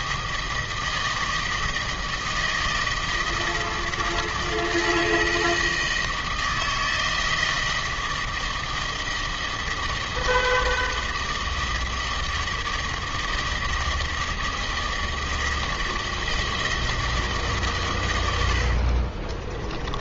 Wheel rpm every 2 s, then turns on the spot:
160, 160, 160, 160, 160, 160, 160, 160, 160, 50.
18-20